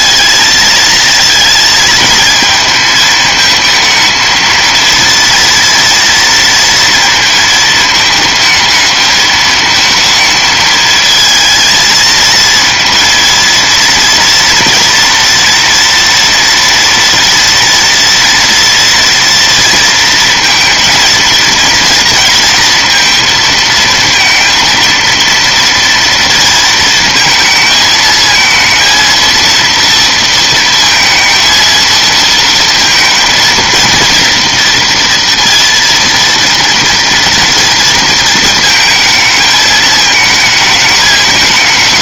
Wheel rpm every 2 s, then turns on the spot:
220, 220, 230, 230, 220, 220, 230, 230, 230, 230, 230, 230, 230, 230, 230, 230, 230, 230, 230, 220, 210.
none